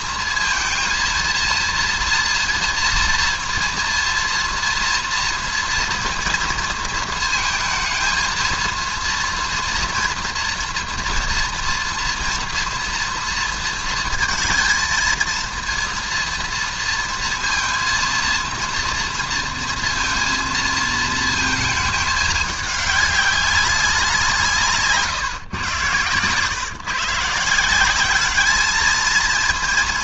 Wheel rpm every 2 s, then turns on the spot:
230, 230, 230, 230, 230, 230, 230, 220, 230, 230, 230, 210, 160, 120, 210.
none